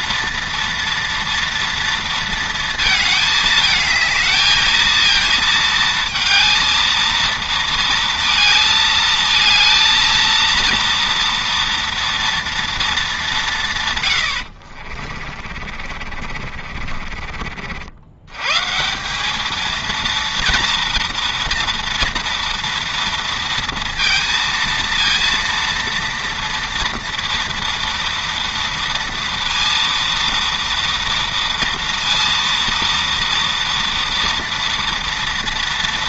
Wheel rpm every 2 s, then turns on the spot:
230, 220, 220, 220, 220, 230, 230, 50, 50, 150, 230, 230, 230, 230, 230, 230, 230, 230.
14-18